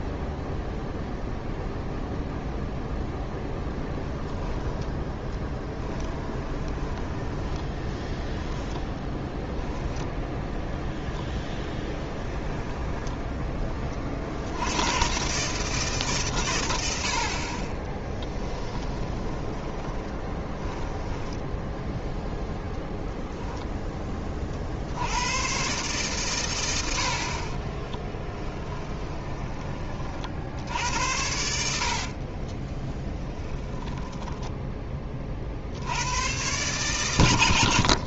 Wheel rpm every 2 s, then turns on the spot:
0, 0, 10, 20, 10, 0, 10, 70, 120, 10, 20, 0, 40, 120, 20, 60, 40, 10, 110.
4-10 12-14 18-22 28-30 32-34